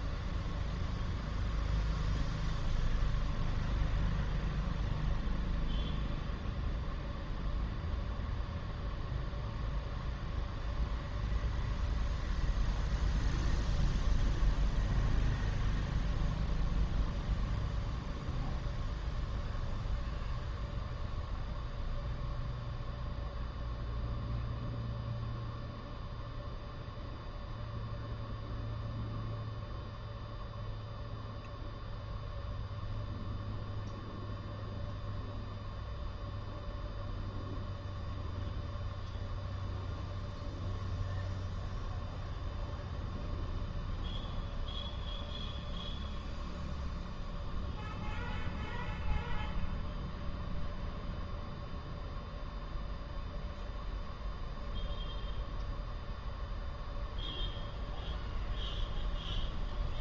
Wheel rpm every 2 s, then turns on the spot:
0, 0, 0, 0, 0, 0, 0, 0, 0, 0, 0, 0, 0, 0, 0, 0, 0, 0, 0, 0, 0, 0, 0, 0, 0, 0, 0, 0, 0, 0.
none